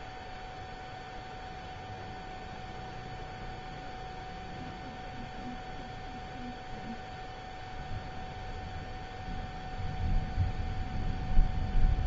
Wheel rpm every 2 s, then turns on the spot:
0, 0, 0, 0, 0, 0.
none